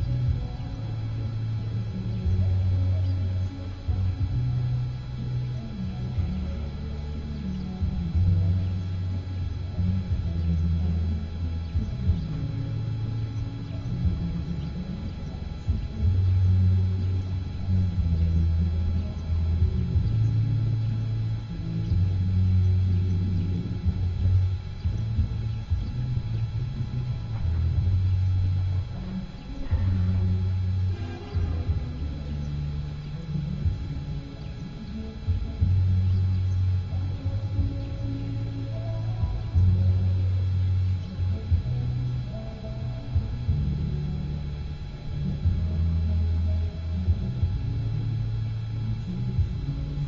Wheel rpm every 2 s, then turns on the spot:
0, 0, 0, 0, 0, 0, 0, 0, 0, 0, 0, 0, 0, 0, 0, 0, 0, 0, 0, 0, 0, 0, 0, 0, 0.
none